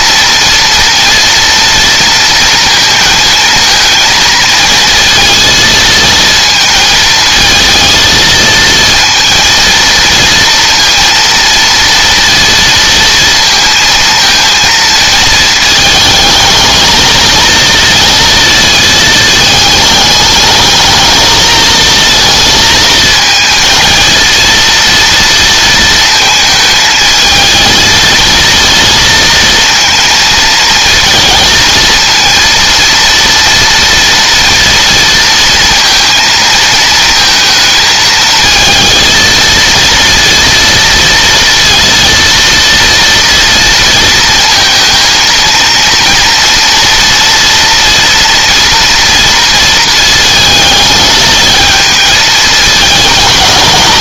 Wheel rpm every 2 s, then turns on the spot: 230, 230, 230, 220, 230, 230, 230, 220, 220, 220, 220, 220, 230, 220, 230, 230, 230, 230, 220, 230, 230, 230, 230, 230, 230, 220, 200.
none